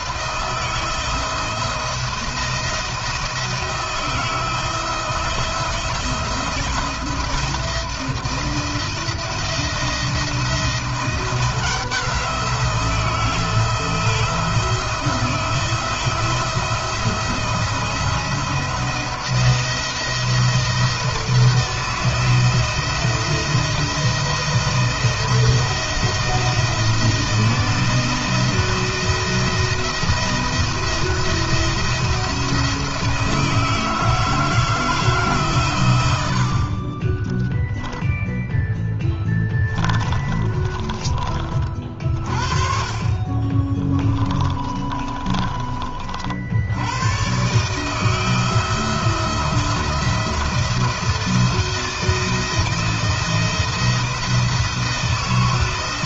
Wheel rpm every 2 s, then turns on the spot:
160, 170, 170, 170, 170, 170, 170, 160, 170, 170, 170, 170, 170, 160, 170, 170, 160, 160, 50, 10, 30, 50, 30, 80, 160, 170, 160, 160.
38-42 44-46